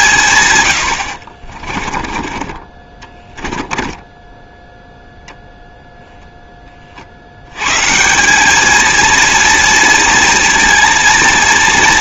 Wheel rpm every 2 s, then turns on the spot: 120, 20, 0, 20, 210, 230.
none